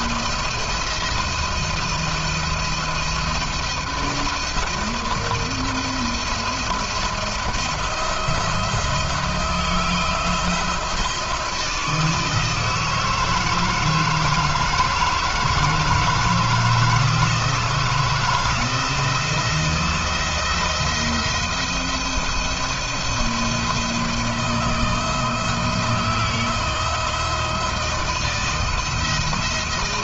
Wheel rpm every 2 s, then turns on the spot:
170, 170, 170, 170, 160, 170, 160, 160, 160, 160, 160, 170, 160, 170, 170.
none